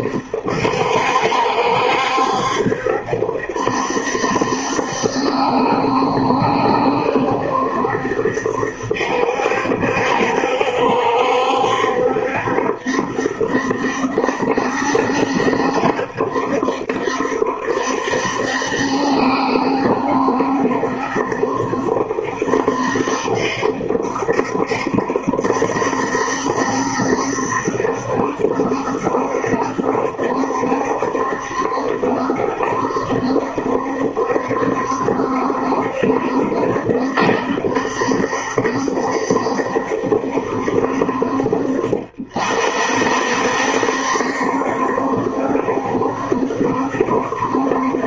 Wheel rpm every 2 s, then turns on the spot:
70, 70, 70, 70, 70, 70, 70, 70, 70, 70, 70, 70, 70, 70, 70, 70, 70, 70, 70, 70, 60, 50, 70, 70.
none